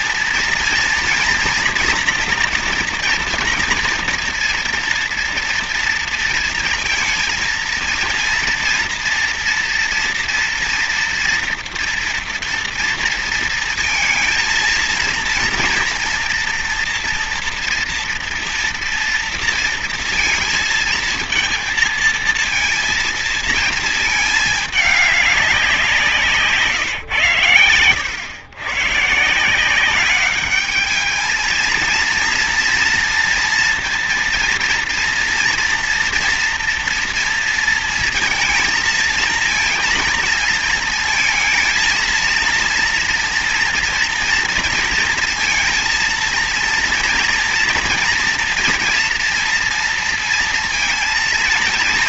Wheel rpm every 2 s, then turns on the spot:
240, 240, 240, 230, 230, 230, 230, 230, 240, 240, 230, 230, 220, 160, 100, 200, 230, 230, 230, 220, 230, 230, 240, 230, 240, 230.
none